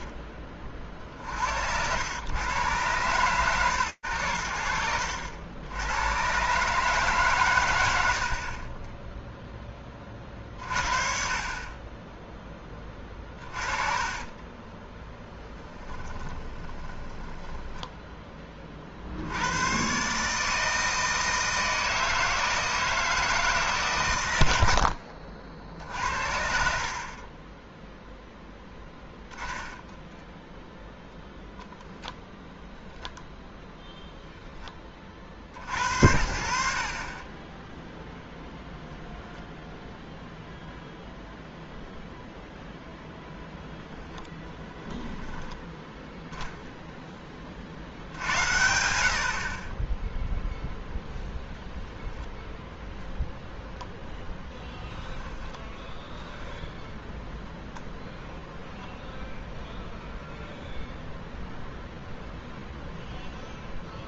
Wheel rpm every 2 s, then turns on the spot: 40, 120, 80, 150, 10, 50, 20, 20, 20, 40, 160, 160, 70, 50, 10, 0, 0, 20, 60, 0, 0, 0, 10, 10, 90, 0, 0, 10, 0, 0, 0, 0.
14-18 24-26 28-30